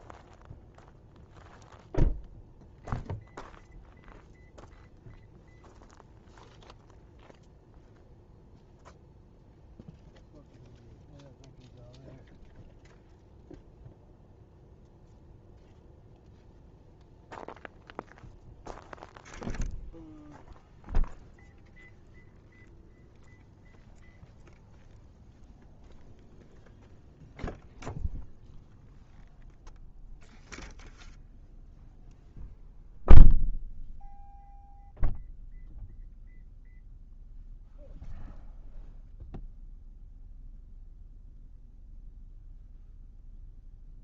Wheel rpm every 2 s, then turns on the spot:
0, 0, 0, 0, 0, 0, 0, 0, 0, 0, 0, 0, 0, 0, 0, 0, 0, 0, 0, 0, 0, 0.
none